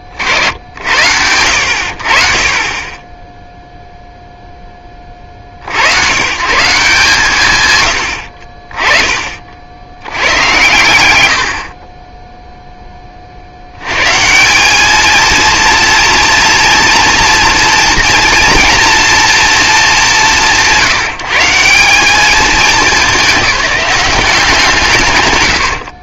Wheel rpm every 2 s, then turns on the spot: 20, 20, 0, 120, 40, 100, 10, 180, 230, 230, 150, 210, 150.
none